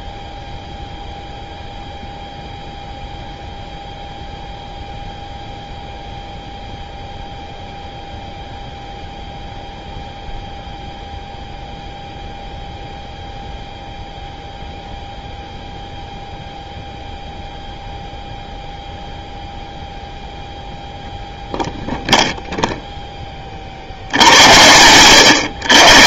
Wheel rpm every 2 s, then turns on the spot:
0, 0, 0, 0, 0, 0, 0, 0, 0, 0, 0, 0, 80.
none